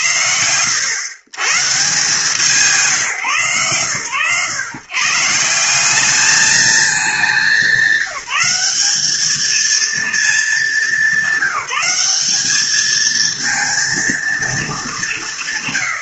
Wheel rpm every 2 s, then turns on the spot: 110, 140, 160, 210, 210, 190, 230, 160.
none